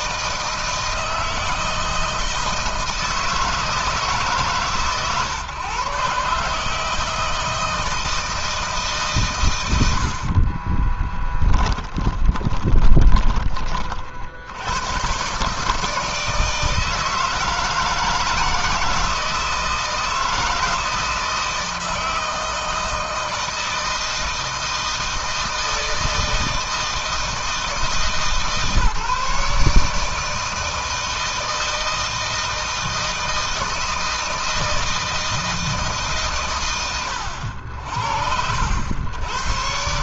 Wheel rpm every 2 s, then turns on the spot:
160, 160, 130, 160, 120, 10, 20, 130, 160, 160, 160, 160, 160, 160, 150, 160, 160, 160, 80, 110.
10-12